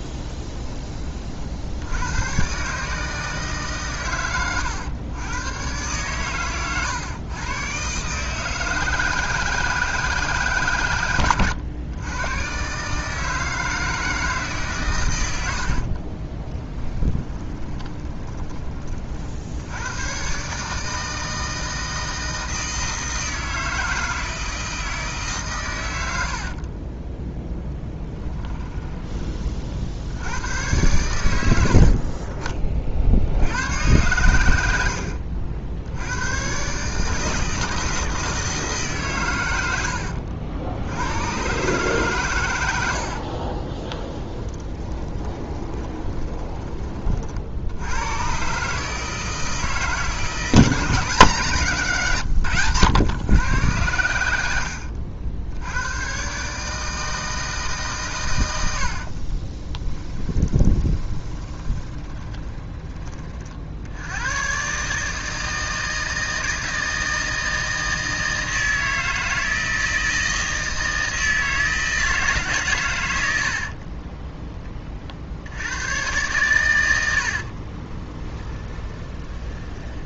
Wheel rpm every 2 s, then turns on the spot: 20, 140, 110, 120, 160, 140, 130, 150, 10, 30, 140, 160, 160, 50, 20, 90, 40, 100, 130, 160, 90, 90, 20, 20, 140, 170, 120, 90, 150, 100, 20, 20, 130, 160, 160, 160, 140, 20, 100, 10.
16-18 26-30 44-46 54-56 60-64 78-80